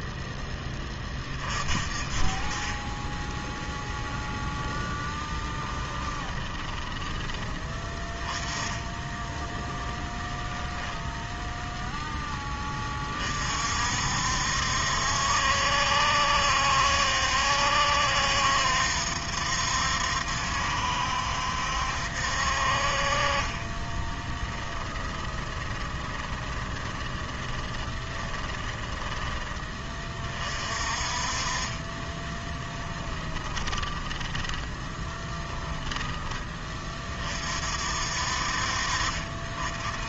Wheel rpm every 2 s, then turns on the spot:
20, 20, 10, 10, 10, 10, 30, 70, 70, 70, 70, 40, 20, 20, 10, 40, 10, 20, 30, 50.
4-8 10-12 24-30 32-36